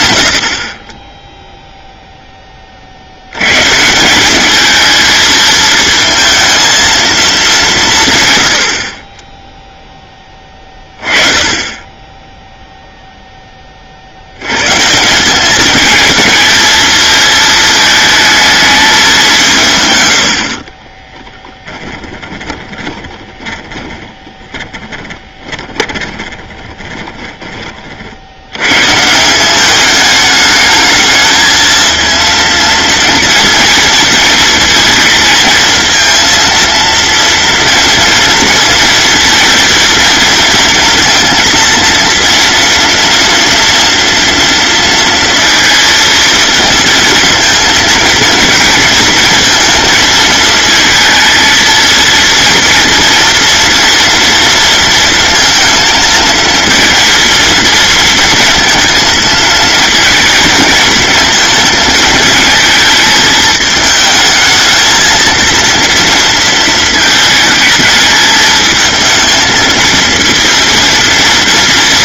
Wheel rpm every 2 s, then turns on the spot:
60, 20, 210, 220, 110, 20, 10, 100, 220, 220, 70, 20, 10, 20, 90, 210, 230, 230, 230, 230, 230, 230, 230, 220, 230, 220, 230, 230, 230, 230, 230, 220, 220, 230, 220, 230.
20-28